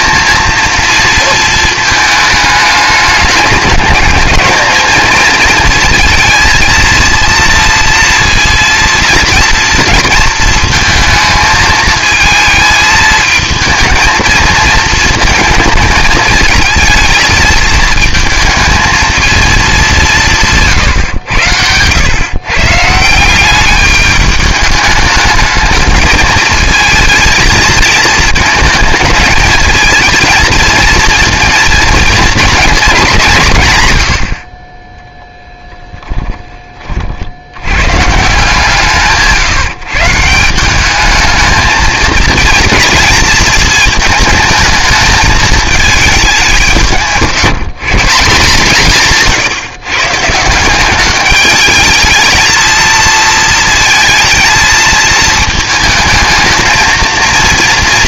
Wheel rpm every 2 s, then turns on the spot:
230, 210, 220, 230, 230, 220, 220, 230, 220, 220, 150, 150, 210, 220, 220, 220, 230, 30, 30, 160, 190, 240, 220, 170, 160, 190, 230, 220, 230.
none